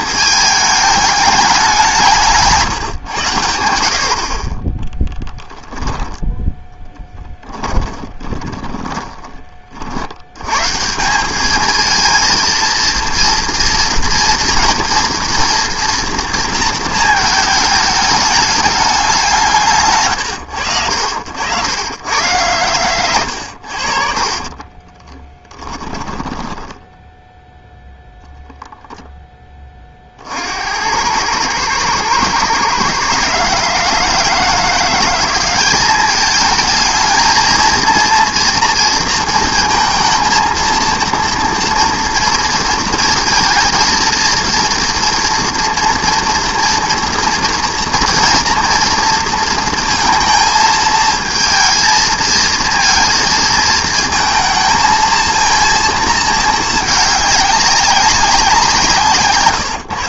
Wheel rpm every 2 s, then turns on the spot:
210, 150, 30, 10, 10, 140, 230, 230, 230, 210, 90, 100, 30, 10, 0, 80, 130, 170, 220, 230, 230, 230, 230, 230, 230, 220, 230, 230, 220, 170.
6-10 24-28